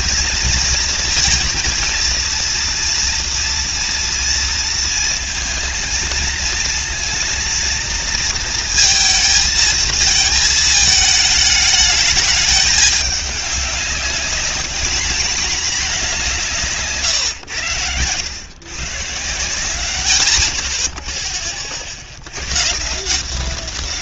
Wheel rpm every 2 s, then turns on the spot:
230, 230, 230, 230, 230, 220, 210, 220, 160, 120, 60, 120.
none